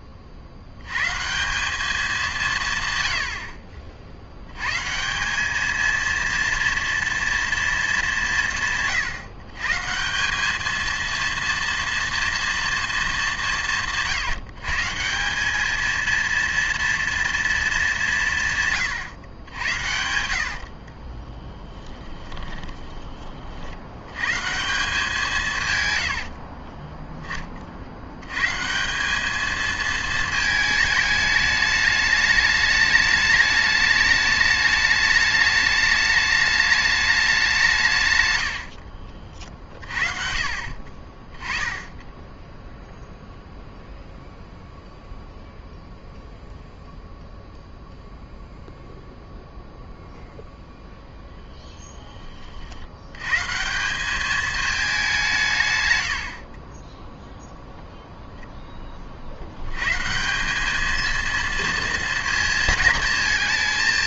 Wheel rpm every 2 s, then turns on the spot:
100, 130, 140, 230, 150, 220, 220, 150, 230, 140, 40, 20, 170, 30, 160, 220, 210, 210, 210, 70, 40, 0, 0, 0, 0, 0, 70, 210, 20, 20, 210, 220.
20-22 26-28 38-40